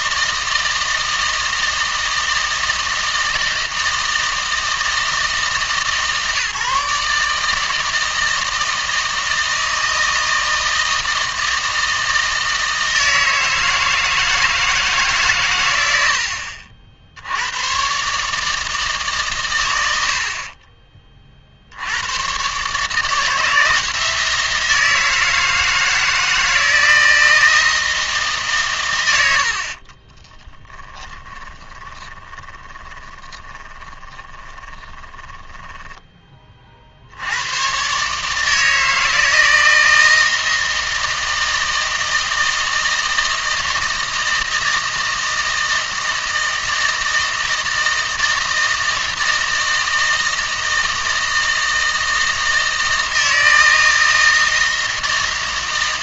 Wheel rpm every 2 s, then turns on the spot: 160, 160, 160, 140, 160, 160, 160, 160, 60, 150, 30, 150, 160, 160, 120, 10, 30, 20, 50, 160, 160, 160, 160, 160, 160, 160, 160, 160.
20-22 30-36